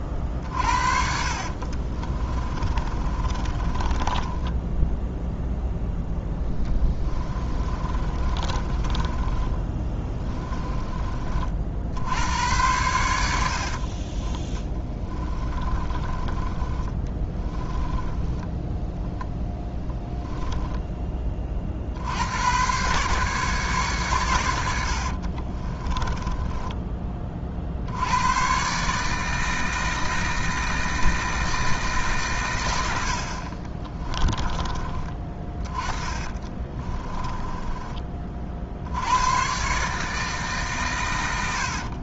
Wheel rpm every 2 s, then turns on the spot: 50, 30, 10, 20, 20, 20, 90, 10, 20, 0, 10, 120, 80, 20, 140, 160, 90, 30, 20, 70, 130.
0-12 14-18 36-38